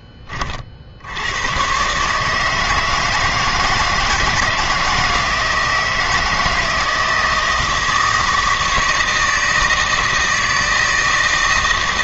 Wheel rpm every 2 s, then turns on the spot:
60, 160, 160, 170, 160, 160.
none